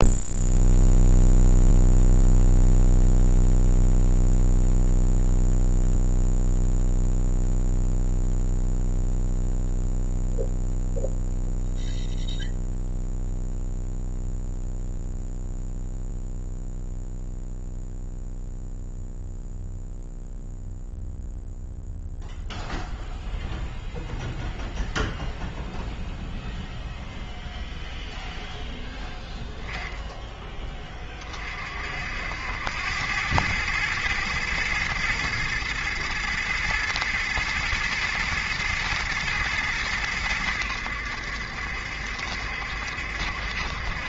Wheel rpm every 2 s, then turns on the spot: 0, 0, 0, 0, 0, 0, 0, 0, 0, 0, 0, 0, 0, 0, 10, 20, 90, 120, 110, 120, 90, 70.
none